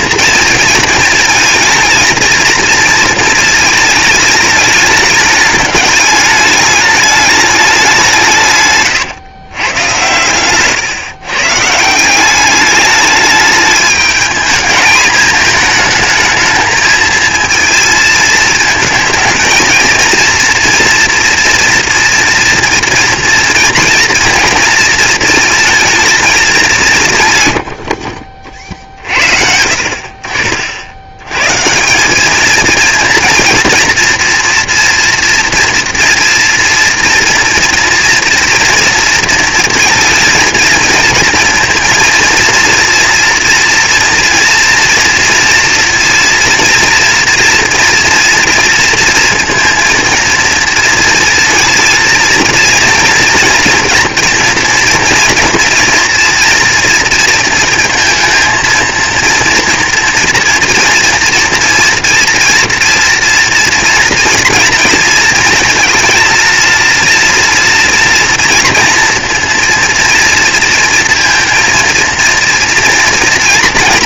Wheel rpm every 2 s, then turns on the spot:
230, 230, 210, 210, 140, 120, 200, 220, 220, 220, 230, 230, 230, 200, 40, 50, 220, 230, 230, 240, 230, 230, 230, 230, 230, 230, 230, 230, 230, 230, 230, 230, 230, 230, 230, 230, 230.
none